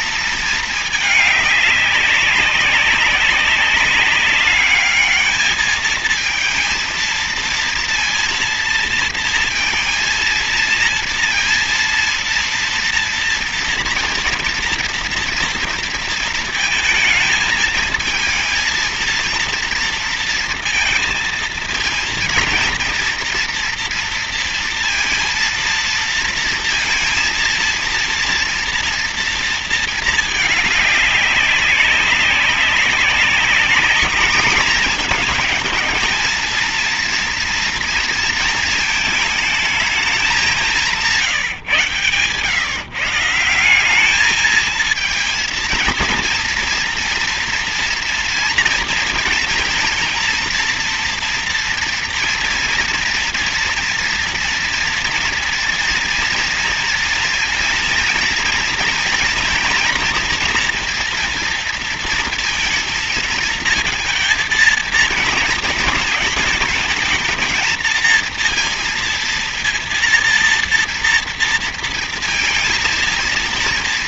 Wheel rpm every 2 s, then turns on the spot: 220, 200, 200, 220, 230, 230, 230, 240, 220, 230, 230, 230, 230, 230, 230, 210, 190, 210, 230, 220, 200, 140, 210, 230, 230, 230, 230, 230, 230, 230, 230, 230, 220, 220, 230, 240, 230.
none